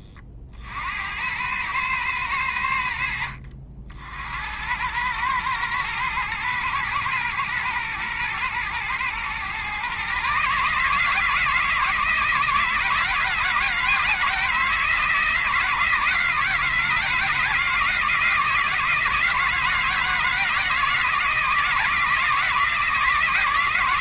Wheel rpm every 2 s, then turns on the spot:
70, 80, 90, 120, 110, 150, 160, 160, 160, 160, 170, 160.
none